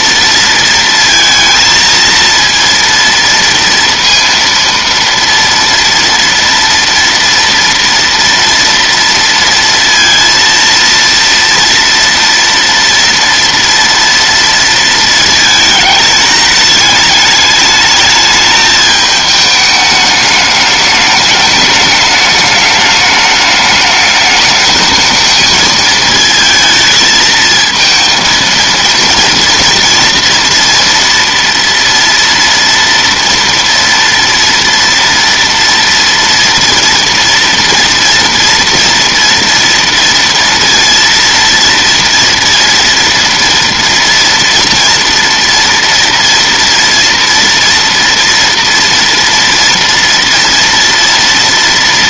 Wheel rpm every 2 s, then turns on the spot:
230, 230, 230, 230, 230, 230, 230, 230, 210, 210, 210, 210, 220, 220, 230, 230, 230, 230, 230, 230, 230, 230, 230, 230, 230, 230.
none